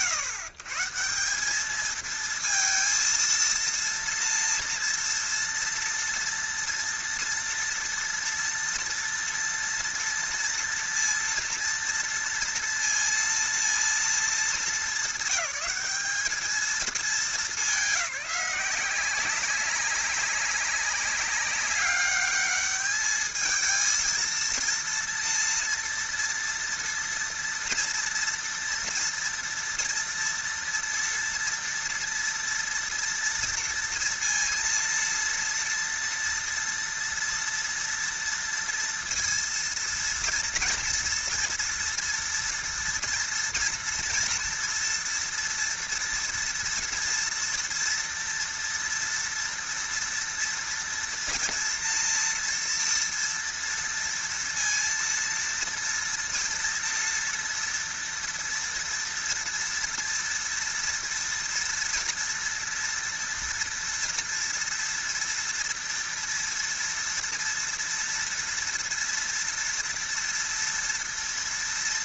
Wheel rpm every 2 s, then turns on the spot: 140, 230, 230, 230, 230, 230, 230, 220, 220, 190, 200, 210, 230, 230, 230, 230, 240, 230, 230, 230, 230, 230, 230, 230, 230, 230, 230, 230, 230, 230, 230, 230, 230, 230, 230, 230.
none